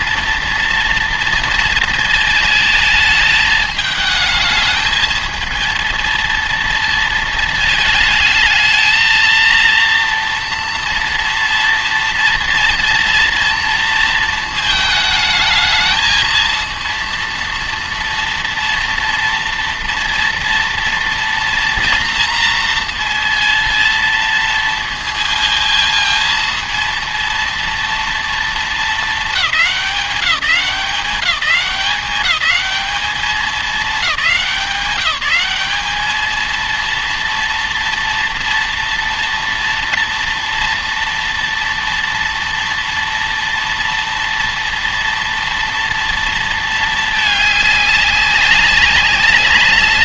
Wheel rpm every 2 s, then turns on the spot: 230, 220, 220, 230, 220, 230, 230, 220, 230, 240, 230, 230, 230, 230, 220, 180, 210, 190, 230, 230, 230, 230, 230, 220, 200.
none